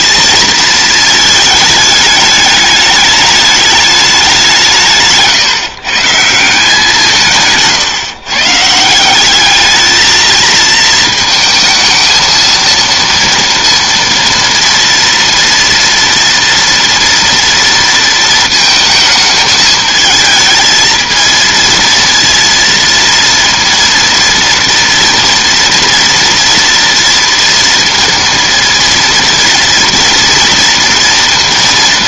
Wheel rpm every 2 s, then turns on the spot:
220, 210, 170, 180, 160, 220, 230, 230, 230, 220, 220, 230, 230, 230, 230, 230.
none